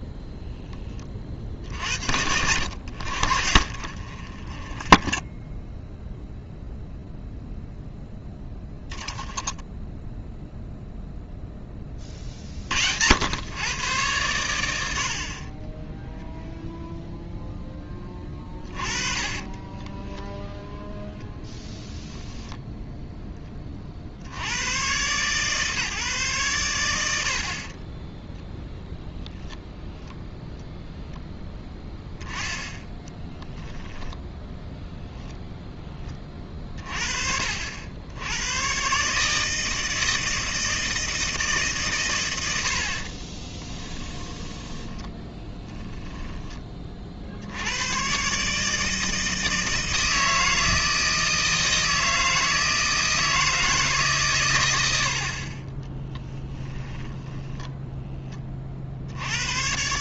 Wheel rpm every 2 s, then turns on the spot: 10, 80, 20, 0, 10, 0, 60, 90, 0, 30, 0, 0, 120, 100, 0, 0, 10, 10, 20, 110, 160, 70, 10, 20, 150, 160, 160, 110, 10, 30.
4-6 8-10 18-20 34-36 44-46 56-58